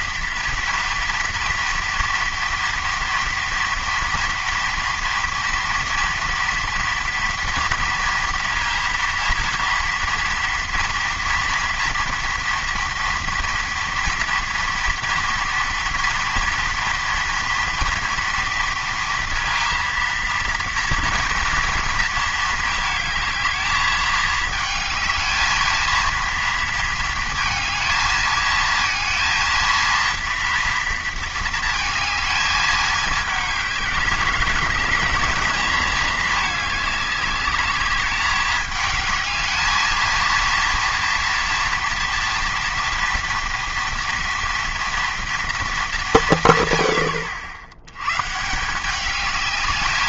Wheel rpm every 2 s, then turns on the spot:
230, 230, 230, 230, 230, 240, 230, 240, 230, 230, 230, 220, 220, 230, 220, 230, 220, 200, 210, 210, 230, 230, 230, 130, 170.
none